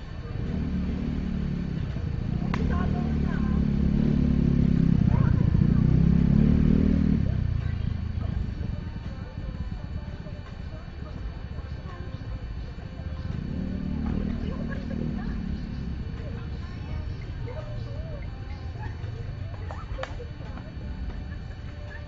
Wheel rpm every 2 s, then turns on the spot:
0, 0, 0, 0, 0, 0, 0, 0, 0, 0, 0.
none